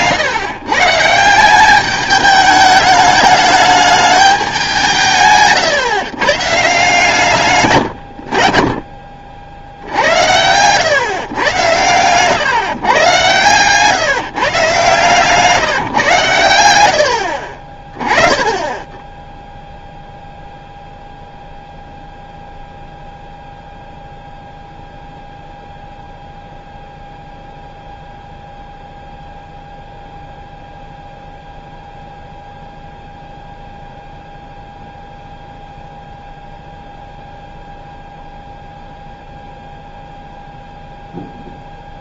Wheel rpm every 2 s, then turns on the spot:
130, 210, 190, 140, 50, 100, 140, 140, 110, 20, 0, 0, 0, 0, 0, 0, 0, 0, 0, 0, 0.
10-12 16-18